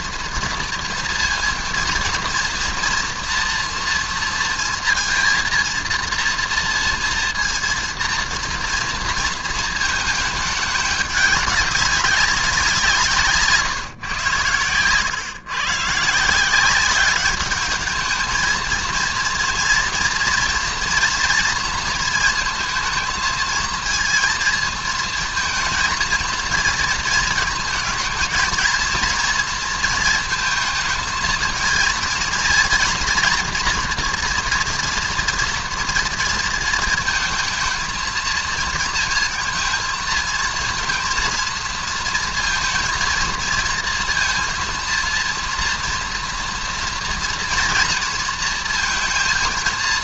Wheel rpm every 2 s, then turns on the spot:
230, 230, 230, 230, 230, 210, 180, 120, 190, 230, 230, 230, 220, 230, 230, 220, 240, 230, 220, 230, 230, 230, 230, 240, 230.
none